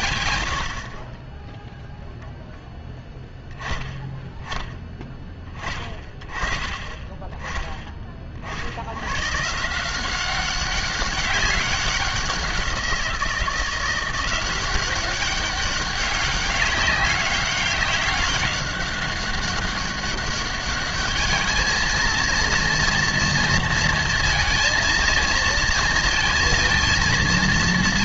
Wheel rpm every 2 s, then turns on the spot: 60, 0, 20, 20, 70, 190, 180, 190, 200, 200, 210, 240, 230, 230.
none